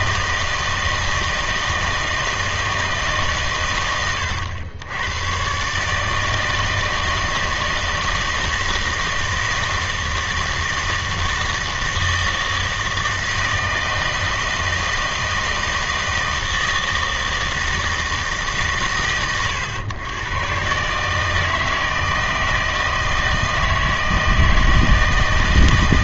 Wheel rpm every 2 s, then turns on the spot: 160, 160, 100, 160, 160, 160, 160, 160, 160, 140, 130, 160, 160.
none